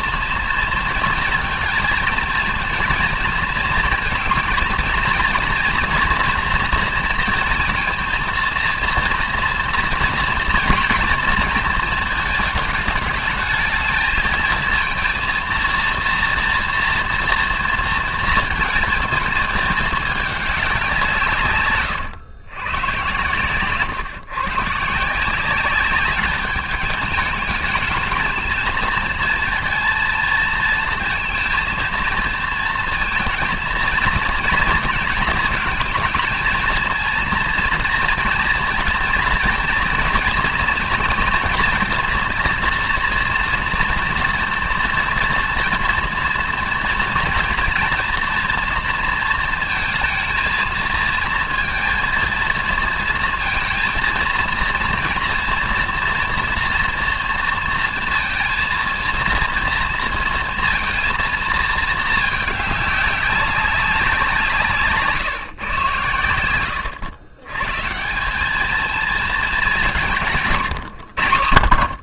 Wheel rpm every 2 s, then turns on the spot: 230, 230, 230, 230, 230, 230, 220, 220, 230, 220, 190, 110, 140, 210, 230, 230, 230, 220, 220, 230, 230, 230, 230, 230, 230, 220, 230, 230, 230, 230, 230, 210, 150, 90, 210, 140.
66-68